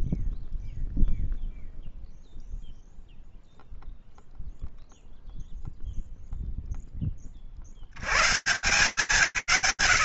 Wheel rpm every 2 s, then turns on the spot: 0, 0, 0, 0, 150.
none